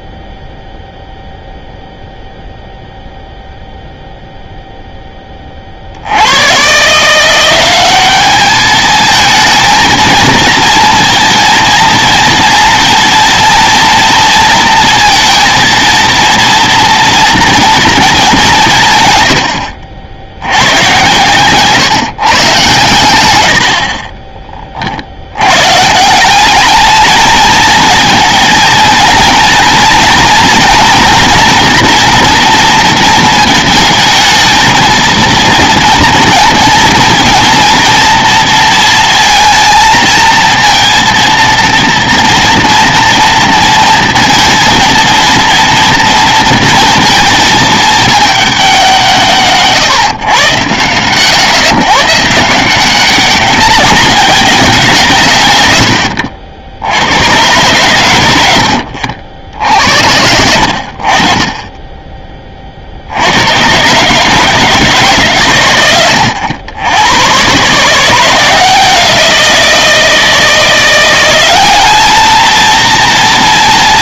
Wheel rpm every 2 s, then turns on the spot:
0, 0, 0, 120, 210, 230, 230, 230, 230, 170, 100, 130, 30, 200, 220, 230, 230, 220, 220, 230, 230, 230, 230, 230, 200, 110, 170, 190, 70, 80, 70, 40, 160, 100, 170, 170, 230.
58-60